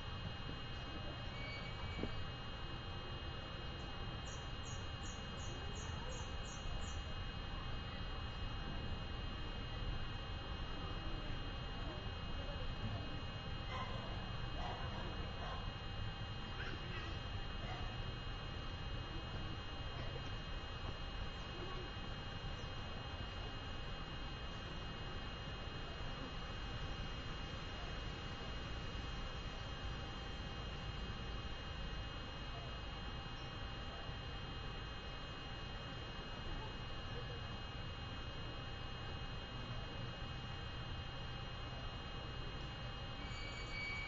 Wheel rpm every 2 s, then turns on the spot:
0, 0, 0, 0, 0, 0, 0, 0, 0, 0, 0, 0, 0, 0, 0, 0, 0, 0, 0, 0, 0, 0.
none